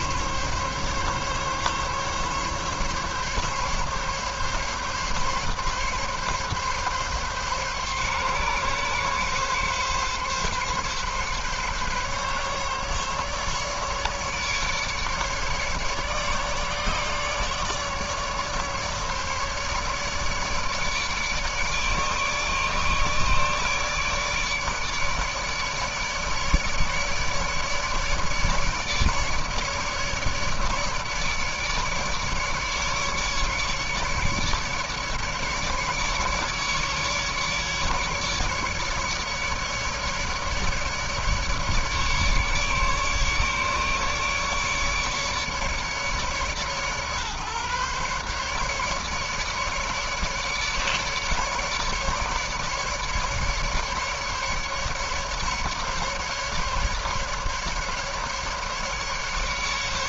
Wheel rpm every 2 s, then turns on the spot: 140, 140, 140, 140, 140, 140, 150, 150, 150, 150, 150, 150, 150, 150, 150, 150, 150, 140, 140, 150, 150, 150, 150, 140, 150, 150, 140, 150, 150, 150.
none